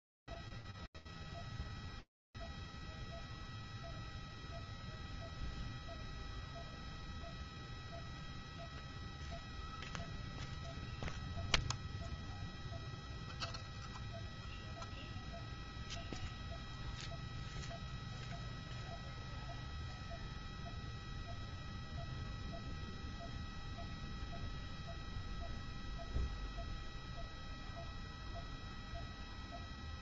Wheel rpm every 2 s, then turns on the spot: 0, 0, 0, 0, 0, 0, 0, 0, 0, 0, 0, 0, 0, 0, 0.
none